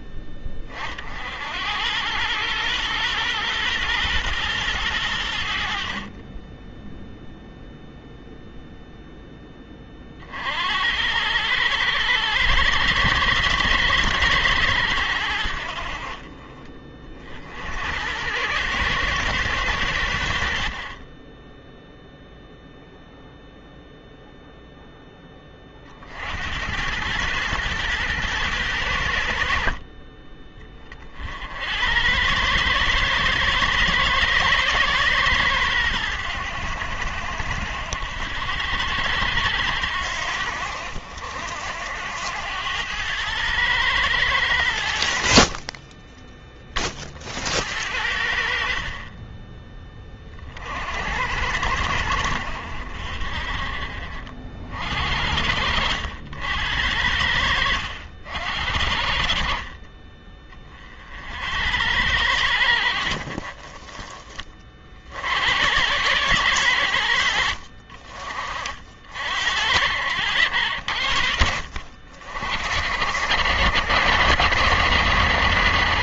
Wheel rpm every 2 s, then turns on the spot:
30, 120, 110, 0, 0, 70, 90, 90, 30, 110, 40, 0, 0, 90, 100, 30, 110, 110, 80, 80, 60, 90, 90, 30, 40, 50, 60, 60, 80, 70, 40, 70, 40, 90, 40, 80, 70, 110.
none